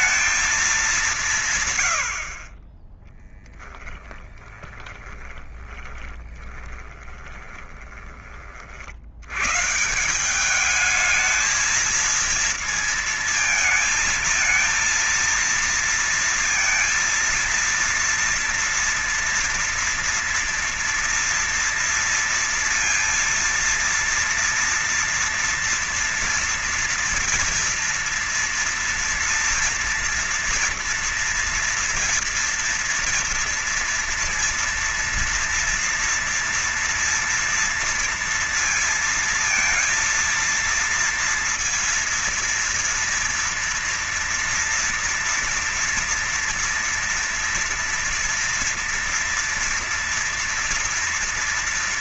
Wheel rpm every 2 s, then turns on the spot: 220, 30, 10, 20, 30, 170, 230, 220, 230, 240, 230, 230, 230, 230, 240, 230, 230, 230, 230, 230, 230, 230, 230, 230, 230, 230.
4-8